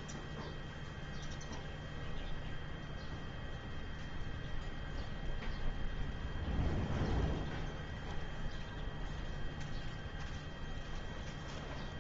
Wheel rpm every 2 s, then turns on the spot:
0, 0, 0, 0, 0, 0.
none